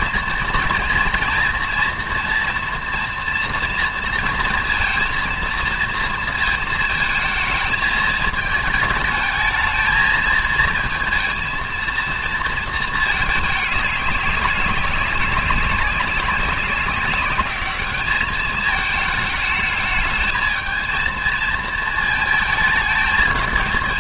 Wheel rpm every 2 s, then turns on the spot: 230, 230, 230, 230, 220, 220, 230, 200, 190, 220, 220, 220.
none